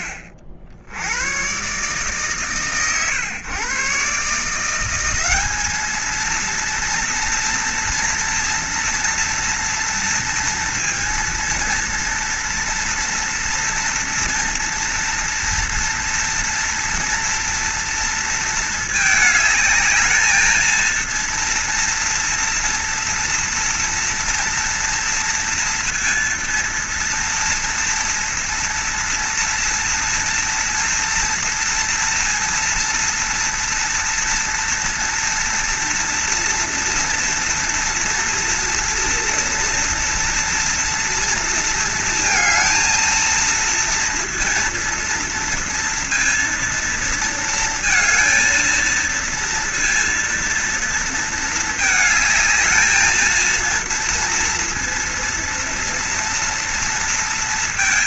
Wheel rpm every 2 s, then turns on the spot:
70, 110, 180, 230, 230, 230, 230, 230, 230, 220, 230, 230, 230, 230, 230, 230, 230, 230, 230, 230, 240, 230, 230, 230, 230, 230, 220, 230, 230.
none